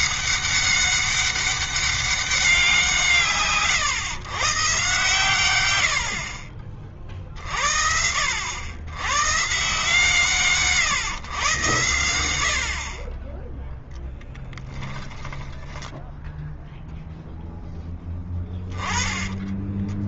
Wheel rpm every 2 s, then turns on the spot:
200, 170, 130, 40, 100, 140, 50, 20, 0, 20.
14-16